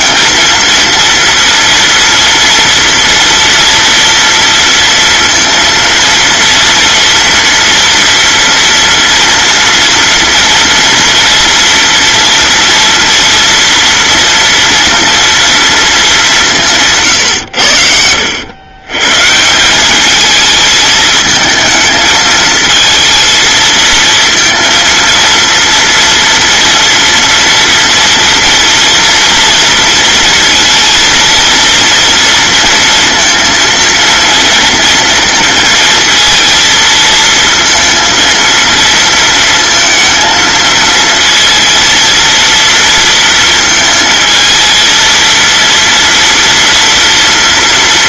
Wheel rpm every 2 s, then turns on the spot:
230, 230, 230, 230, 230, 230, 230, 230, 150, 120, 220, 220, 230, 230, 230, 230, 230, 230, 230, 230, 230, 230, 220, 230.
none